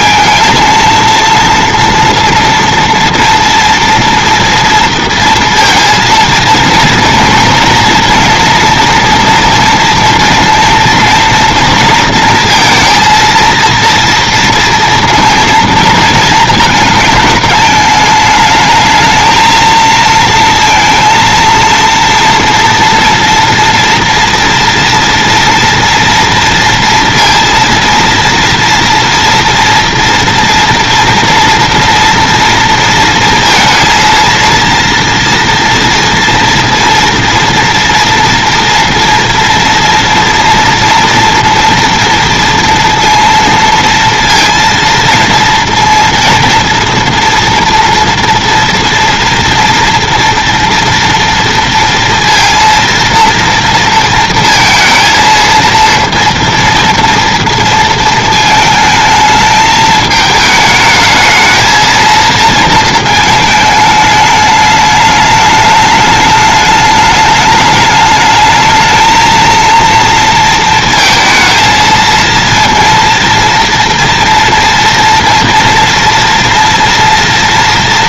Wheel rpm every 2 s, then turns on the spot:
230, 230, 230, 230, 230, 230, 230, 230, 220, 220, 230, 230, 230, 230, 230, 230, 230, 230, 230, 240, 240, 230, 230, 230, 230, 230, 230, 230, 230, 220, 220, 220, 210, 210, 220, 230, 230, 240, 230.
none